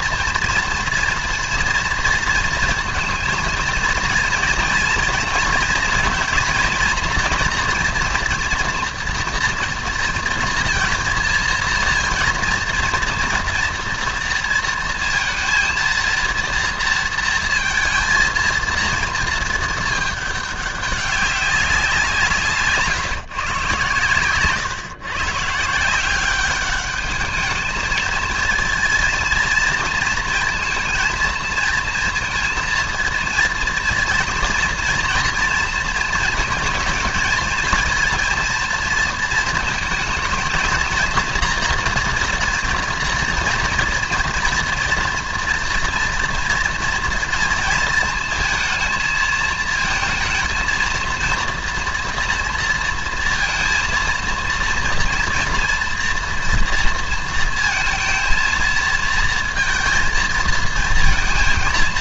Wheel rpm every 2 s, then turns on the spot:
230, 230, 230, 230, 230, 230, 230, 230, 230, 230, 200, 150, 130, 200, 230, 230, 230, 230, 230, 230, 230, 230, 230, 230, 220, 230, 230, 230, 230, 230, 230.
none